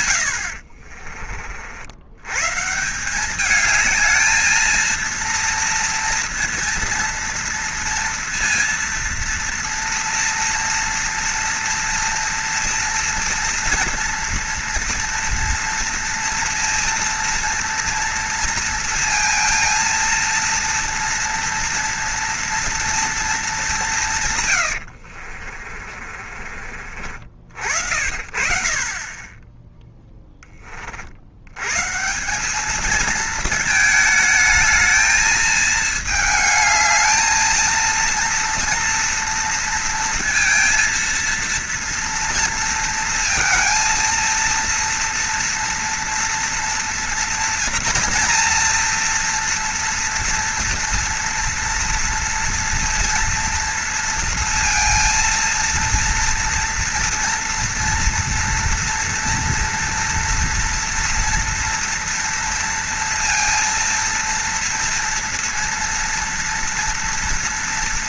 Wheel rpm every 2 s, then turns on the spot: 70, 140, 220, 230, 230, 230, 230, 230, 230, 230, 230, 230, 110, 40, 30, 20, 200, 220, 220, 230, 230, 230, 230, 240, 230, 230, 230, 230, 230, 230, 230, 230, 230, 240.
0-2 24-28